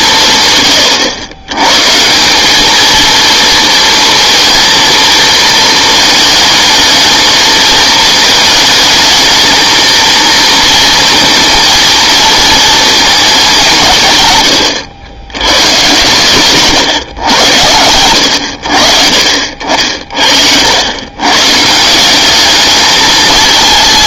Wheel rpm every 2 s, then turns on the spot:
120, 210, 230, 220, 220, 220, 230, 110, 130, 80, 80, 210.
14-16